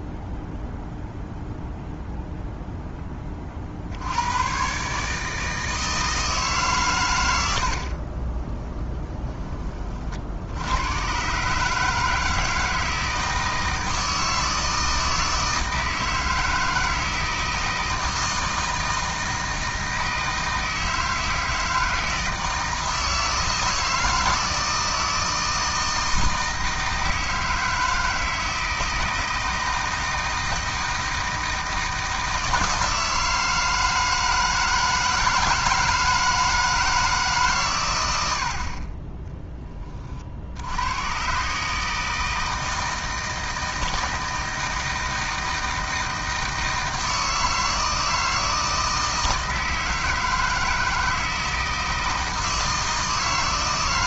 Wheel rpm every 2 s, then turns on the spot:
0, 10, 140, 120, 20, 90, 160, 160, 160, 160, 160, 160, 160, 160, 160, 160, 160, 160, 160, 30, 100, 160, 160, 160, 160, 160, 160.
8-10